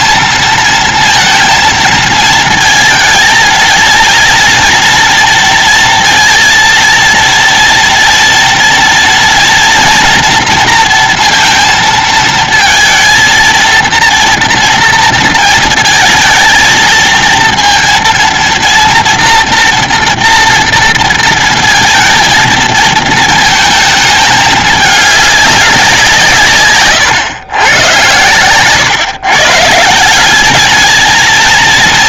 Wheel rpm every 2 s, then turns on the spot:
230, 220, 230, 230, 240, 230, 230, 230, 230, 230, 230, 220, 210, 120, 140, 220.
none